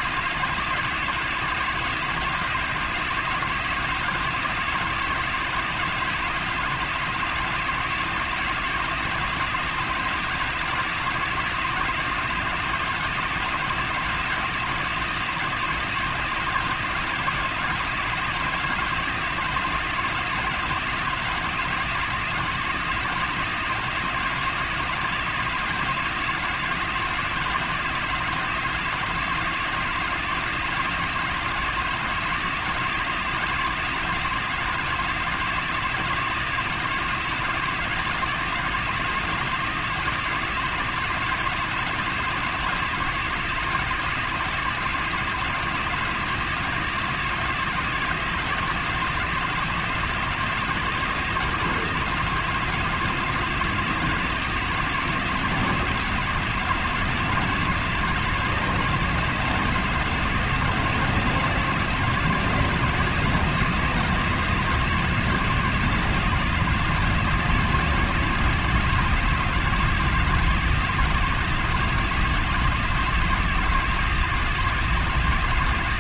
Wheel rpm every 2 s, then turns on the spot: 170, 170, 170, 170, 170, 170, 170, 170, 170, 170, 170, 170, 170, 160, 170, 160, 170, 170, 170, 170, 170, 160, 160, 170, 170, 170, 170, 170, 160, 170, 170, 170, 170, 160, 170, 170, 160, 170.
none